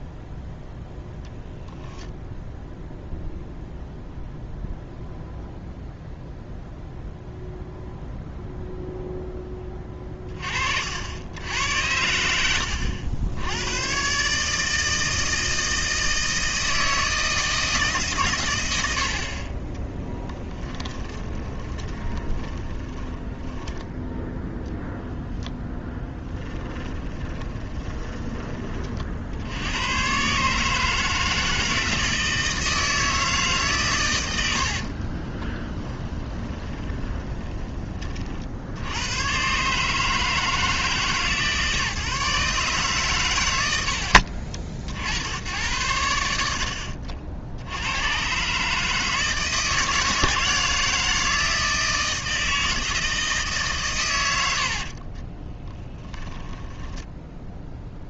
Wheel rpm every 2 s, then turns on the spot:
0, 0, 0, 0, 0, 60, 80, 160, 160, 90, 20, 20, 0, 20, 40, 160, 160, 60, 20, 80, 150, 140, 70, 60, 150, 160, 160, 50, 10.
20-24 26-28 34-38 54-58